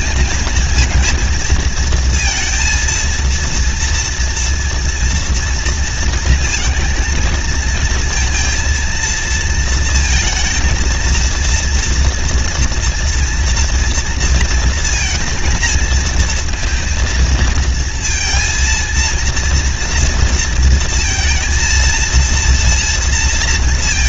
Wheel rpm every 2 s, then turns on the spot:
220, 230, 230, 230, 230, 220, 230, 230, 230, 230, 230, 230.
none